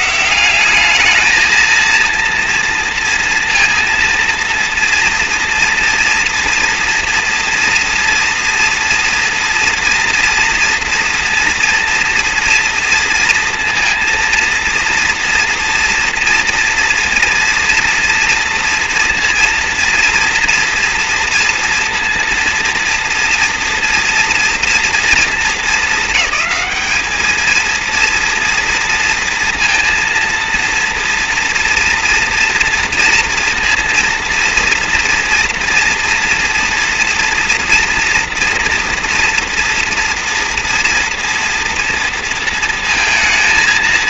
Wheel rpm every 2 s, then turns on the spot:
180, 230, 230, 230, 230, 230, 230, 230, 230, 230, 230, 230, 230, 220, 230, 230, 230, 230, 230, 240, 230, 230.
none